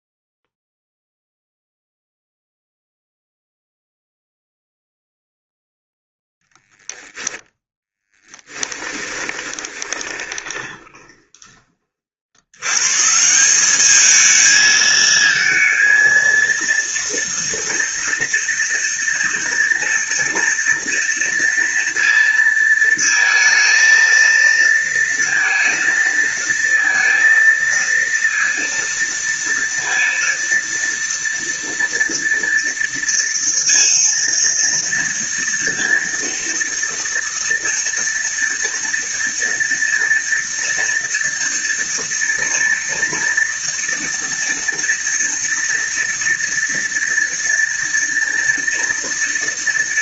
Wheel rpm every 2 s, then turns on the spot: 0, 0, 0, 0, 10, 20, 120, 220, 230, 230, 230, 230, 230, 230, 230, 230, 230, 230, 230, 230, 230, 230, 230, 230, 230.
8-12